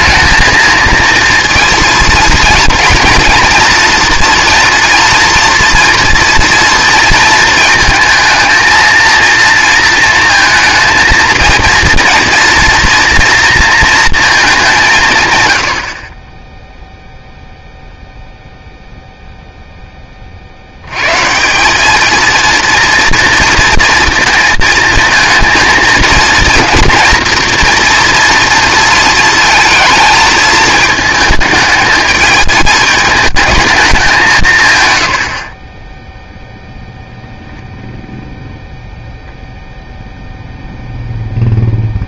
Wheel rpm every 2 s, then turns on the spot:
220, 230, 230, 230, 230, 230, 230, 180, 0, 0, 70, 230, 220, 230, 230, 220, 210, 150, 0, 0, 0.
none